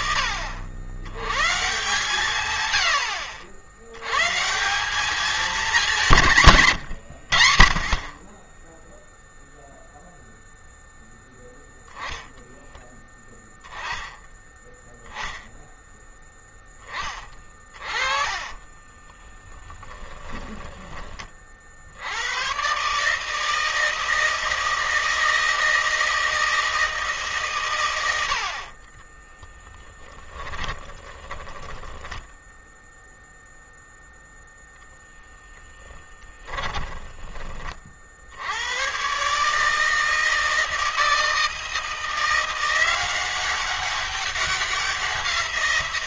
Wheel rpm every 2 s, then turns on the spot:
100, 90, 200, 100, 0, 0, 10, 10, 20, 20, 20, 150, 160, 150, 20, 20, 0, 0, 20, 110, 160, 180, 180.
16-20 28-32